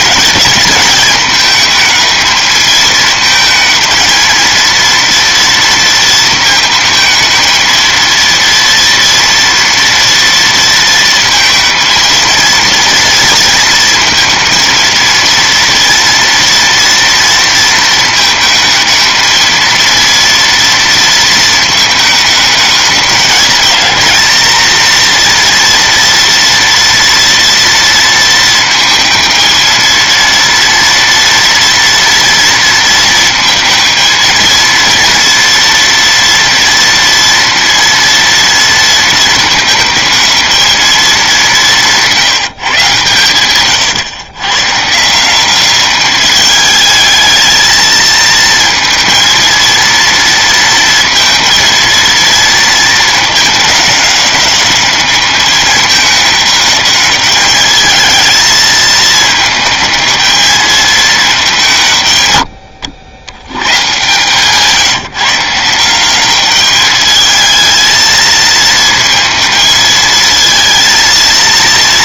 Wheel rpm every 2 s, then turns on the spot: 210, 220, 230, 220, 230, 230, 230, 230, 230, 220, 230, 210, 230, 240, 220, 230, 220, 230, 230, 220, 200, 130, 170, 220, 230, 230, 220, 210, 210, 220, 210, 90, 160, 210, 220, 230.
none